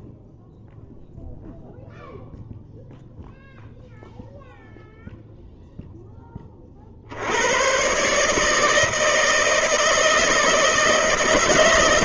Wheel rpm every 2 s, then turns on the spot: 10, 0, 0, 40, 160, 160.
none